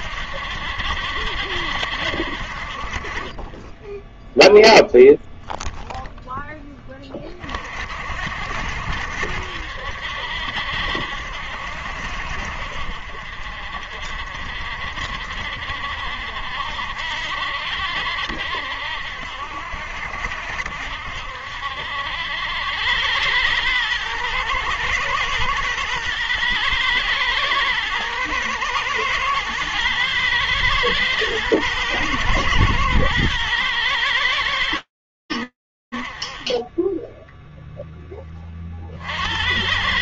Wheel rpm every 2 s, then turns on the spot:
70, 40, 0, 10, 60, 70, 60, 50, 60, 60, 70, 90, 120, 120, 110, 110, 110, 110, 30, 50.
none